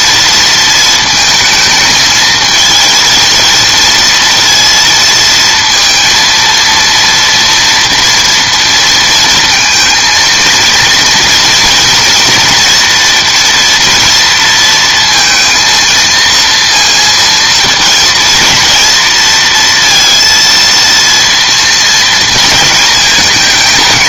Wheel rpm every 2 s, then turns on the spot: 230, 230, 230, 230, 230, 230, 240, 230, 230, 220, 230, 230.
none